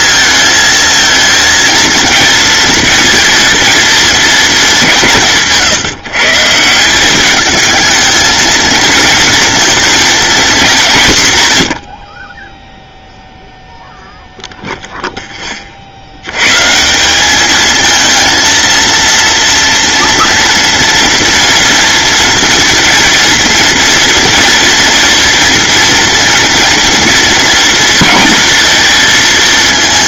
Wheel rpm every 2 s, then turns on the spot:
220, 220, 170, 190, 230, 170, 0, 0, 160, 230, 230, 230, 230, 230, 220.
none